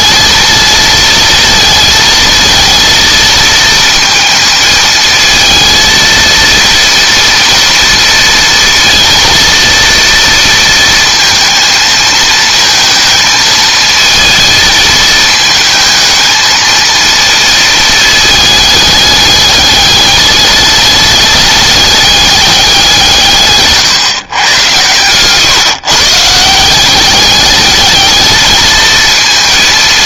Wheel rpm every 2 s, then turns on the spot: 220, 230, 220, 230, 230, 230, 230, 220, 230, 210, 210, 190, 110, 190, 220.
none